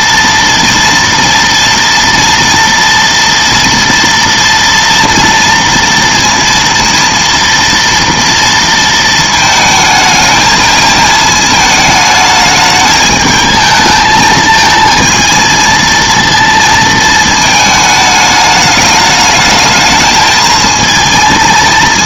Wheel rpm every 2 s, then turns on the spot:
230, 230, 230, 230, 230, 220, 210, 220, 230, 210, 220.
none